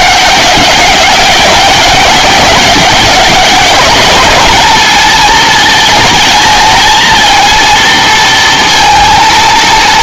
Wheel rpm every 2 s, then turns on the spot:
200, 200, 230, 220, 230.
none